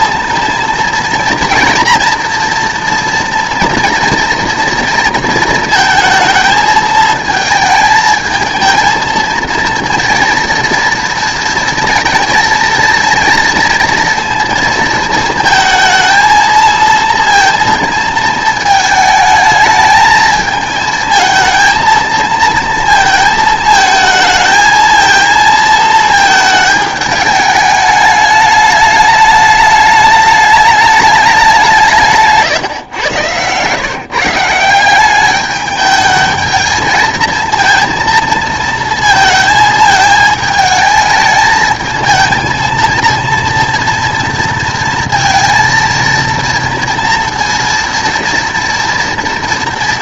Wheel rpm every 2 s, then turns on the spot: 230, 240, 230, 220, 220, 230, 230, 230, 230, 220, 220, 230, 220, 220, 210, 210, 150, 170, 220, 220, 220, 230, 230, 230, 230.
32-34